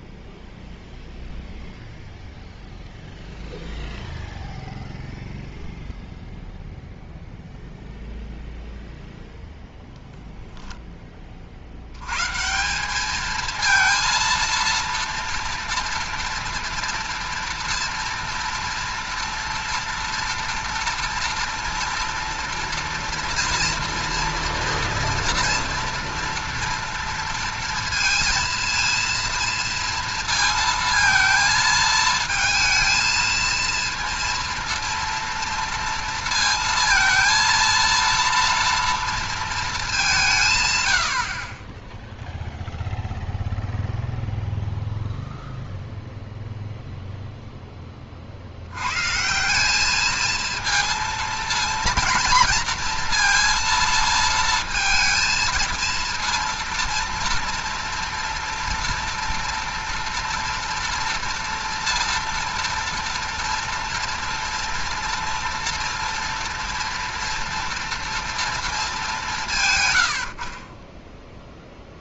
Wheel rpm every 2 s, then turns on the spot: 0, 0, 0, 0, 0, 0, 170, 230, 230, 230, 230, 230, 230, 230, 230, 230, 220, 230, 230, 230, 140, 0, 0, 0, 80, 230, 230, 230, 230, 230, 230, 230, 230, 230, 230, 50.
none